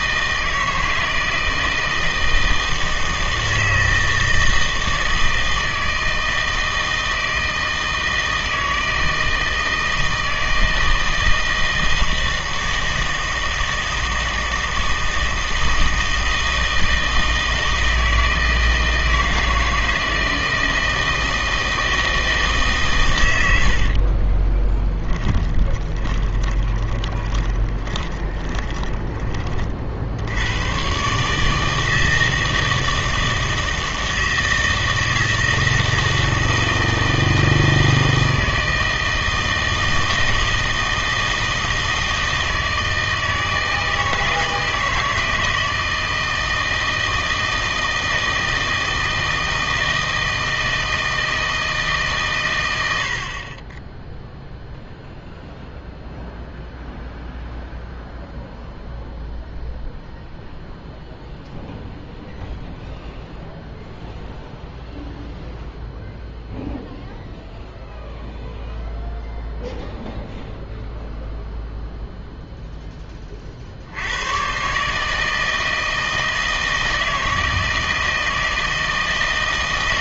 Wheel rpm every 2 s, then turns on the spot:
160, 160, 160, 160, 160, 160, 160, 160, 160, 160, 160, 150, 20, 20, 20, 100, 160, 160, 160, 160, 160, 160, 160, 160, 160, 160, 100, 0, 0, 0, 0, 0, 0, 0, 0, 0, 0, 130, 160, 160.
24-30